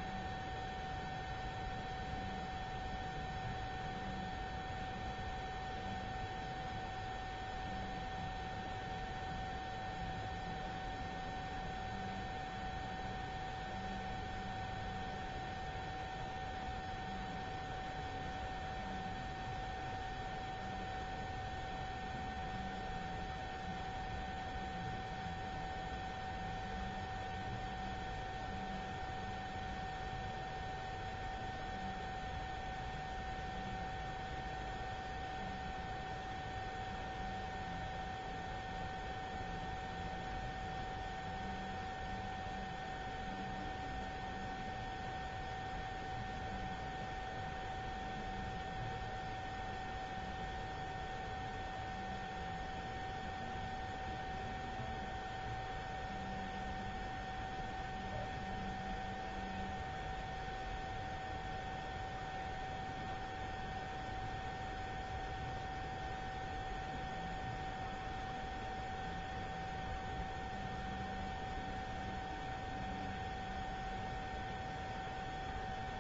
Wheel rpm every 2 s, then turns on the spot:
0, 0, 0, 0, 0, 0, 0, 0, 0, 0, 0, 0, 0, 0, 0, 0, 0, 0, 0, 0, 0, 0, 0, 0, 0, 0, 0, 0, 0, 0, 0, 0, 0, 0, 0, 0, 0, 0.
none